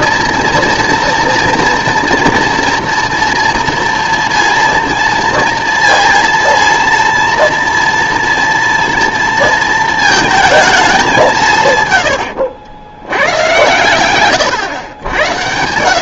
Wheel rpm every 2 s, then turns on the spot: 240, 230, 230, 230, 230, 220, 70, 130.
12-14